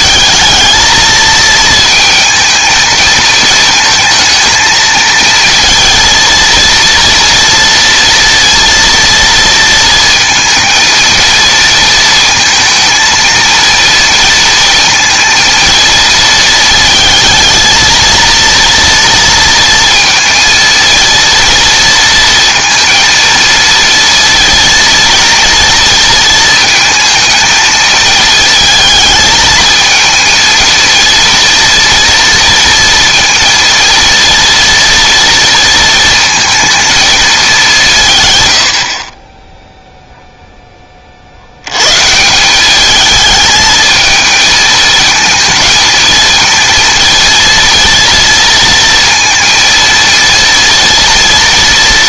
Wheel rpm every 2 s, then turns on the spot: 220, 220, 220, 230, 230, 230, 230, 230, 220, 230, 230, 230, 230, 230, 220, 230, 230, 230, 220, 50, 20, 210, 220, 230, 230, 230.
none